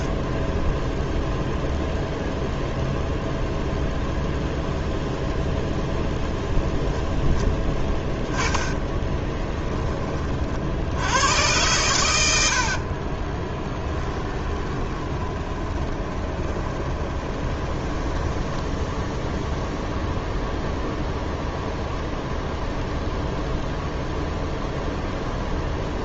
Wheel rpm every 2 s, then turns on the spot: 0, 0, 0, 0, 10, 70, 50, 20, 20, 10, 0, 0, 0.
8-10 12-20